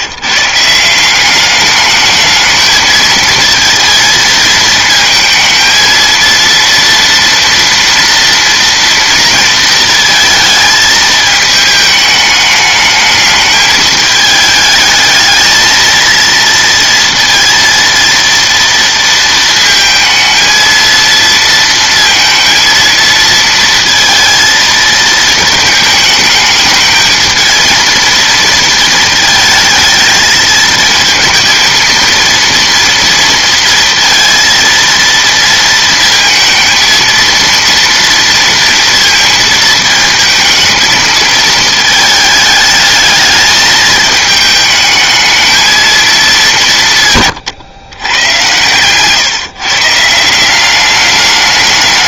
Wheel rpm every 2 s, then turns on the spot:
180, 220, 230, 230, 230, 220, 210, 220, 230, 230, 230, 230, 220, 220, 220, 220, 230, 230, 230, 230, 220, 210, 220, 150, 130, 190.
none